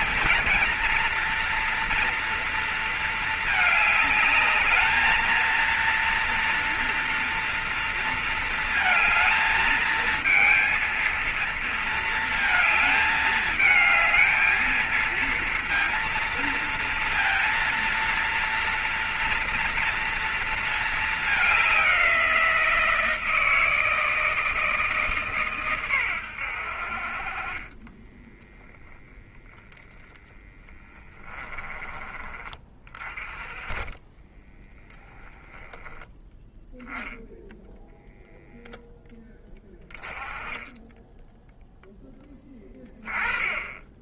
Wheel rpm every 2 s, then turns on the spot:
230, 230, 210, 230, 230, 220, 220, 220, 230, 230, 230, 180, 160, 90, 20, 10, 30, 10, 0, 10, 10, 10.
28-32 34-36